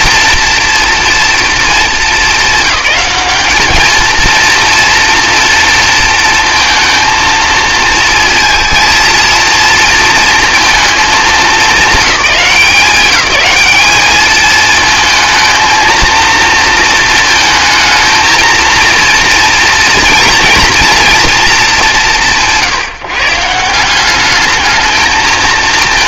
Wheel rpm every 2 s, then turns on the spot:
230, 200, 230, 230, 230, 230, 210, 220, 230, 230, 230, 140, 210.
none